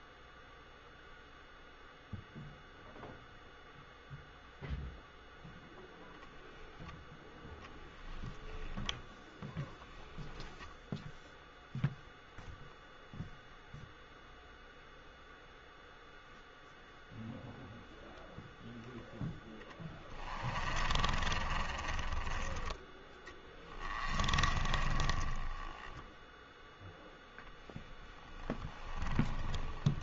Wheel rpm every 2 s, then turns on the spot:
0, 0, 0, 0, 10, 10, 0, 0, 0, 0, 30, 10, 20, 0, 20.
20-22 24-26 28-30